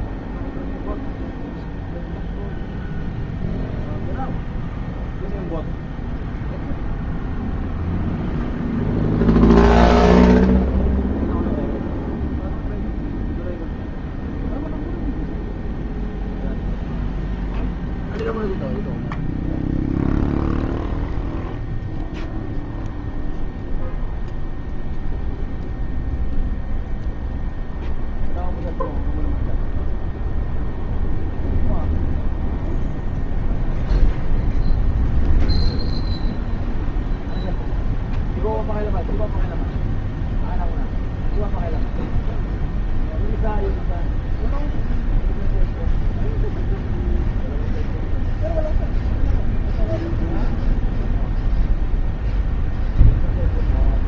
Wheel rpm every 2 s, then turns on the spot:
0, 0, 0, 0, 0, 0, 0, 0, 0, 0, 0, 0, 0, 0, 0, 0, 0, 0, 0, 0, 0, 0, 0, 0, 0, 0, 0.
none